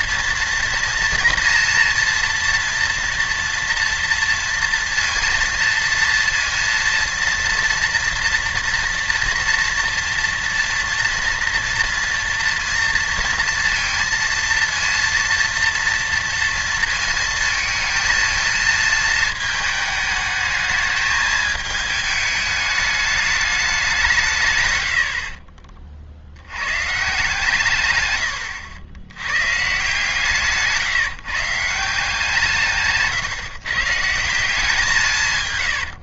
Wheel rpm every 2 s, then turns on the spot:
240, 240, 230, 230, 240, 230, 230, 230, 230, 220, 220, 210, 120, 110, 80, 150, 150, 180.
none